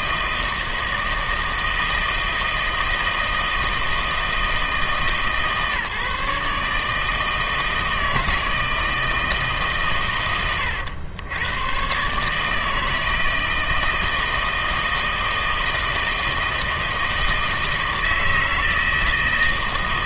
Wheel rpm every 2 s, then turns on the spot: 160, 160, 150, 150, 160, 100, 160, 160, 160, 160.
none